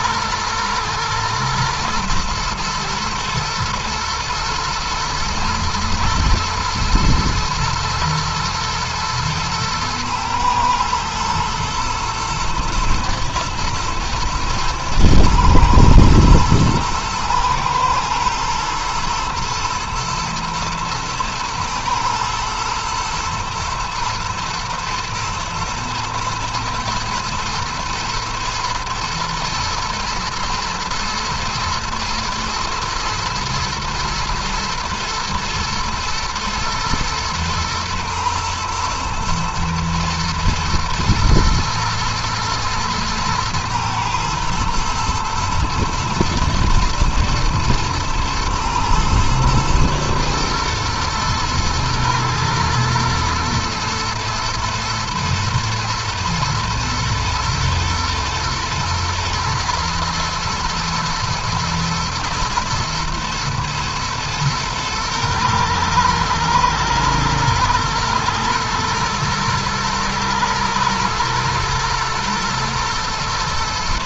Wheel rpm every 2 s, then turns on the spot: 110, 110, 110, 110, 110, 110, 110, 110, 120, 120, 120, 120, 120, 110, 110, 120, 110, 110, 110, 110, 110, 110, 110, 110, 120, 110, 110, 110, 110, 120, 120, 120, 120, 110, 110, 110, 120.
none